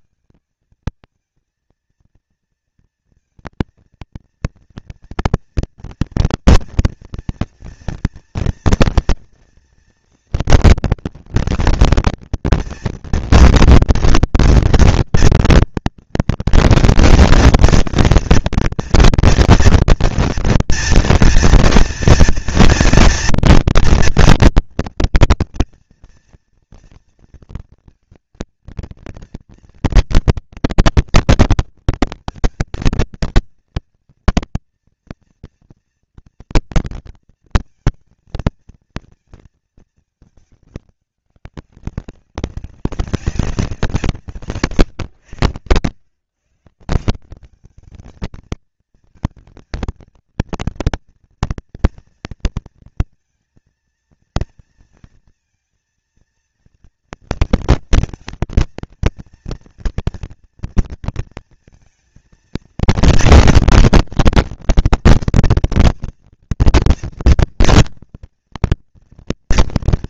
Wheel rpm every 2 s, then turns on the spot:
220, 230, 230, 230, 230, 230, 230, 240, 240, 240, 230, 230, 230, 230, 230, 230, 230, 240, 230, 230, 200, 190, 110, 160, 220, 230, 230, 230, 230, 230, 230, 230, 230, 230, 230.
none